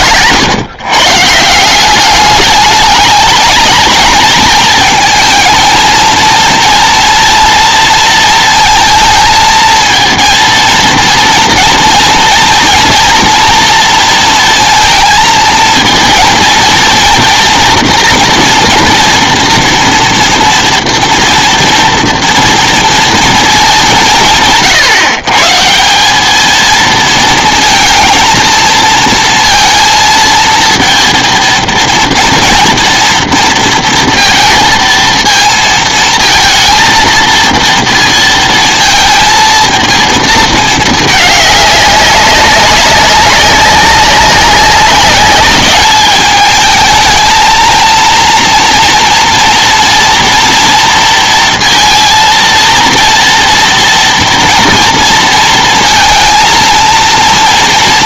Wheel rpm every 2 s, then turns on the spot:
130, 210, 220, 230, 230, 230, 230, 230, 230, 230, 230, 230, 150, 220, 230, 230, 230, 230, 220, 230, 220, 200, 190, 220, 230, 230, 230, 230, 230.
none